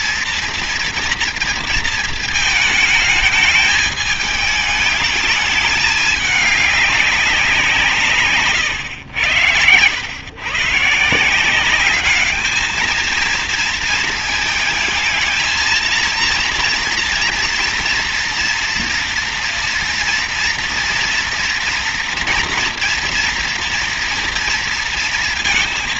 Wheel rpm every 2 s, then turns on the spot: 230, 220, 220, 200, 100, 150, 220, 220, 240, 230, 230, 230, 230.
none